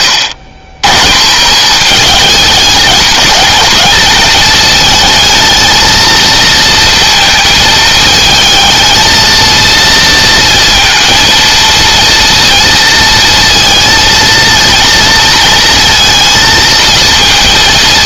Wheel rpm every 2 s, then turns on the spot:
130, 210, 220, 230, 220, 230, 230, 230, 230.
none